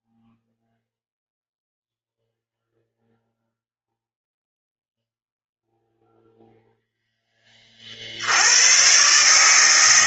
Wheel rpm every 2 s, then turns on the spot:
0, 0, 0, 0, 100.
none